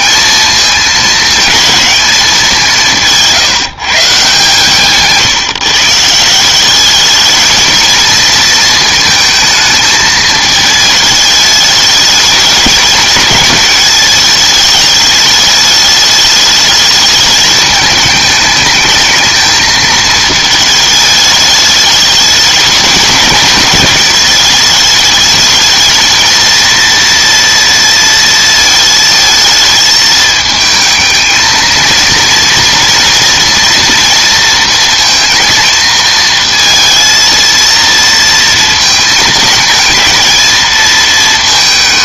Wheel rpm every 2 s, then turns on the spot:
220, 180, 150, 190, 220, 220, 220, 210, 210, 220, 220, 210, 210, 230, 220, 220, 230, 230, 230, 230, 220.
none